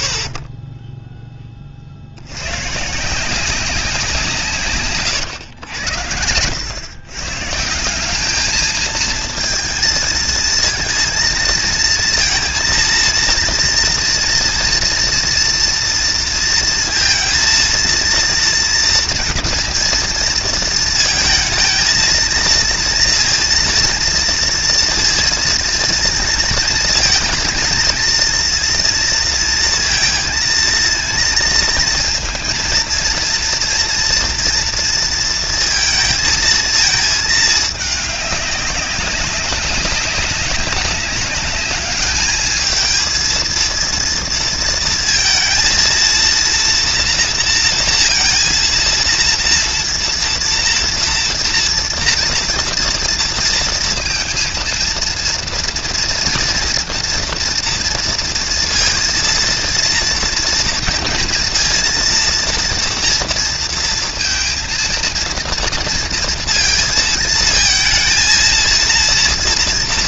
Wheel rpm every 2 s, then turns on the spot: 60, 110, 150, 100, 210, 230, 230, 230, 230, 230, 230, 230, 230, 230, 230, 230, 230, 230, 220, 200, 200, 220, 230, 230, 230, 230, 230, 230, 230, 230, 230, 230, 230, 230, 230.
none